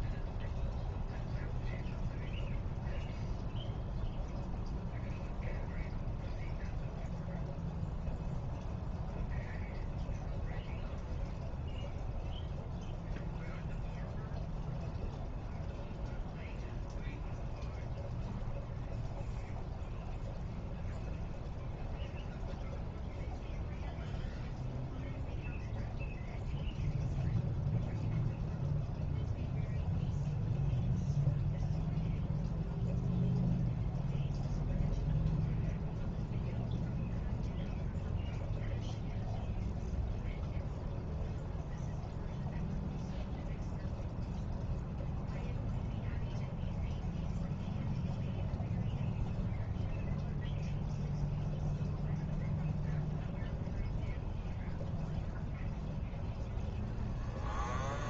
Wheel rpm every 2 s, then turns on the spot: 0, 0, 0, 0, 0, 0, 0, 0, 0, 0, 0, 0, 0, 0, 0, 0, 0, 0, 0, 0, 0, 0, 0, 0, 0, 0, 0, 0, 0.
none